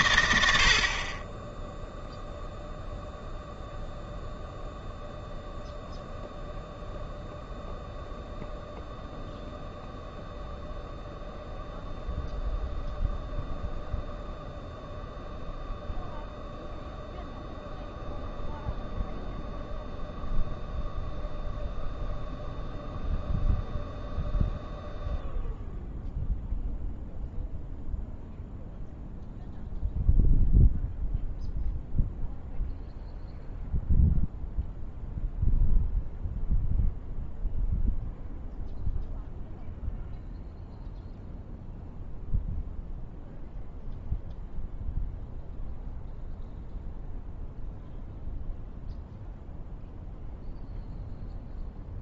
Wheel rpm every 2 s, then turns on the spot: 70, 0, 0, 0, 0, 0, 0, 0, 0, 0, 0, 0, 0, 0, 0, 0, 0, 0, 0, 0, 0, 0, 0, 0, 0, 0.
none